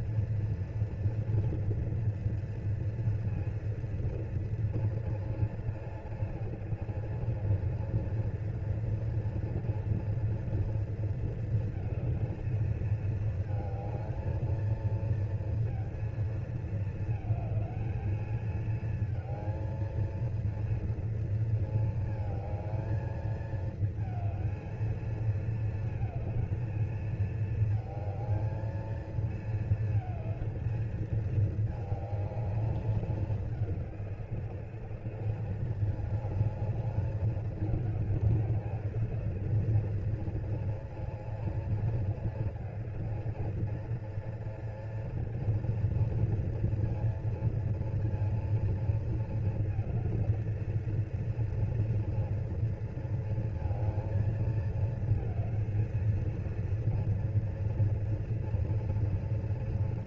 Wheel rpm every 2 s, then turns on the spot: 230, 230, 230, 230, 230, 230, 220, 220, 230, 220, 230, 220, 230, 230, 220, 220, 210, 200, 210, 220, 220, 220, 240, 230, 230, 230, 230, 230, 230, 230.
none